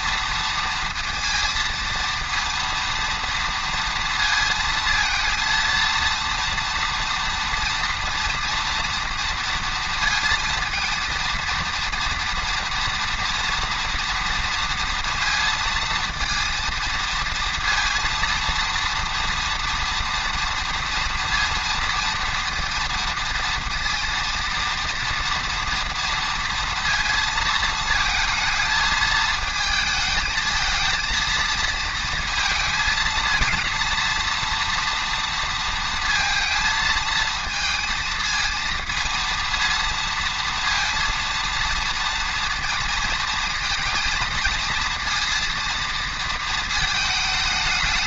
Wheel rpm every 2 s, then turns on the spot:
230, 230, 230, 230, 240, 230, 230, 230, 230, 230, 230, 230, 230, 230, 220, 230, 220, 230, 220, 230, 230, 230, 230, 220.
none